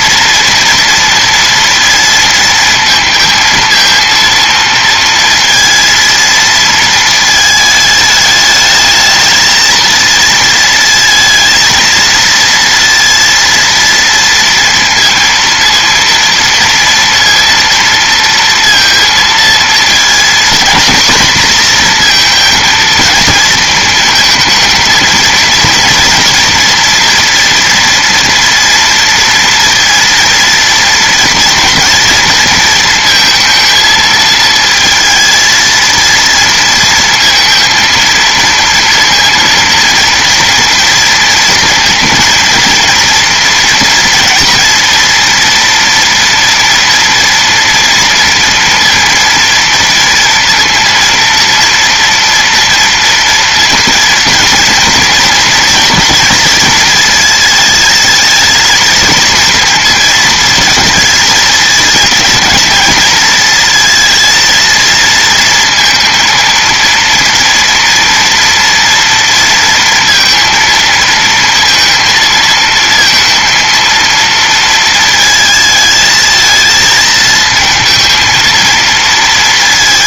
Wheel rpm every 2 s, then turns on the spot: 230, 230, 230, 230, 210, 230, 230, 230, 230, 230, 230, 230, 220, 230, 230, 230, 230, 220, 230, 230, 230, 230, 230, 230, 230, 230, 230, 230, 230, 220, 220, 220, 230, 230, 230, 230, 230, 220, 220, 230.
none